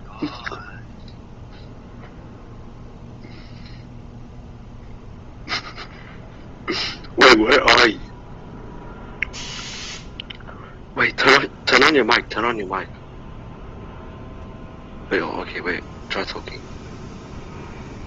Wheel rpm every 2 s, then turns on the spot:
0, 0, 0, 0, 0, 0, 0, 0, 0.
none